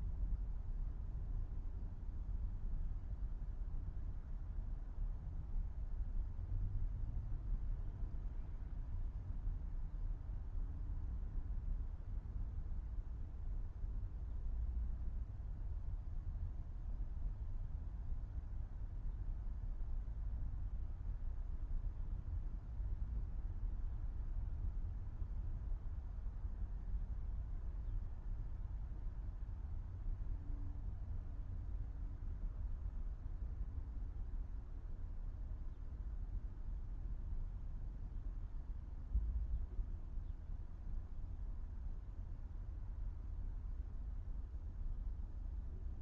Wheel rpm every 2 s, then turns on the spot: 0, 0, 0, 0, 0, 0, 0, 0, 0, 0, 0, 0, 0, 0, 0, 0, 0, 0, 0, 0, 0, 0, 0.
none